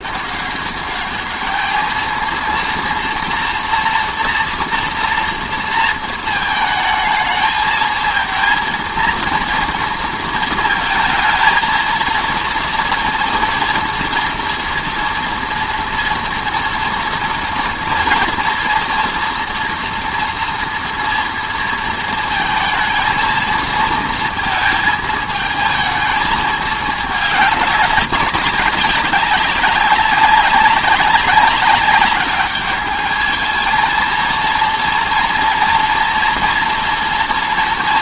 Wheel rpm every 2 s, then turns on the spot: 200, 230, 230, 220, 230, 230, 230, 230, 230, 230, 230, 220, 220, 220, 190, 190, 210, 230, 240.
none